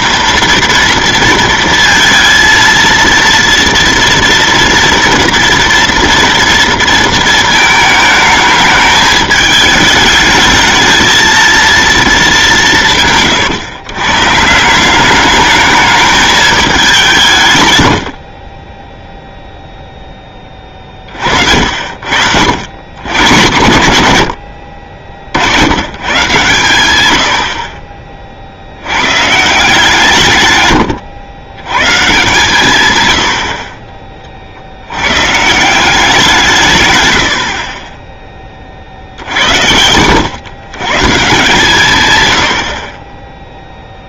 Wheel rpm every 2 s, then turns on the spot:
230, 230, 230, 230, 210, 220, 170, 170, 200, 20, 20, 110, 70, 110, 70, 110, 130, 70, 150, 40, 140, 60.
30-32